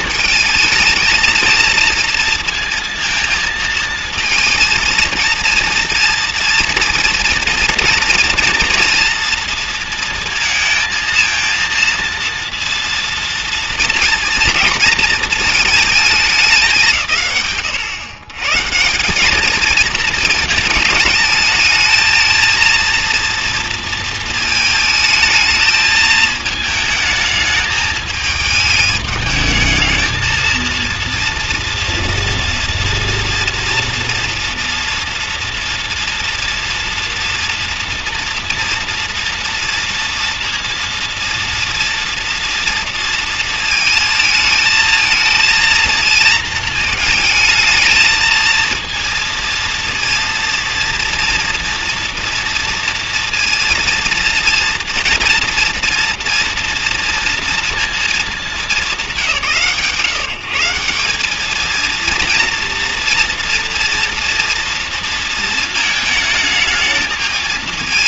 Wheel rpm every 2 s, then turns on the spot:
220, 220, 230, 230, 230, 230, 230, 230, 190, 130, 220, 230, 220, 220, 210, 220, 240, 230, 230, 230, 230, 230, 220, 230, 220, 230, 230, 230, 230, 200, 160, 230, 240, 220.
none